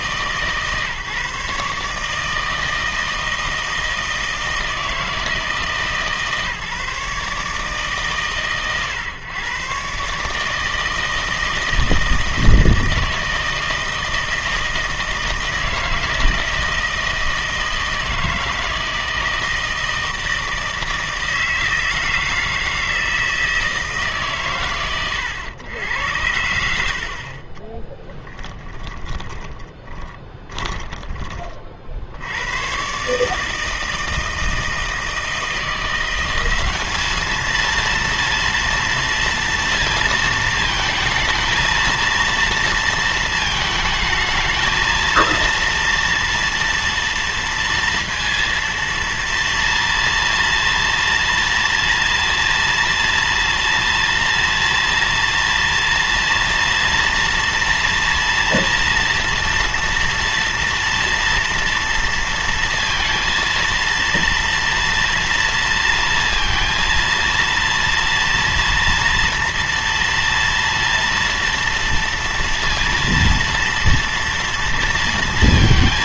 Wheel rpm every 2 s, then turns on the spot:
150, 160, 160, 150, 130, 160, 160, 160, 160, 160, 160, 160, 130, 80, 10, 20, 120, 160, 190, 230, 220, 230, 220, 230, 230, 230, 230, 230, 230, 230, 230, 230, 230, 230, 230, 230, 230, 230.
26-32